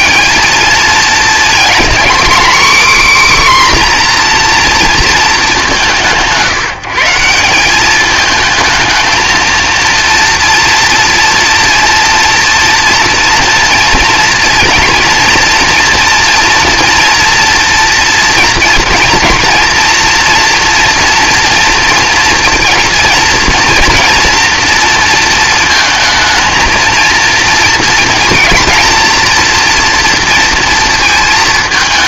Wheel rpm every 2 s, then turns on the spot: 220, 260, 230, 170, 220, 230, 230, 230, 230, 230, 230, 230, 230, 220, 230, 230.
none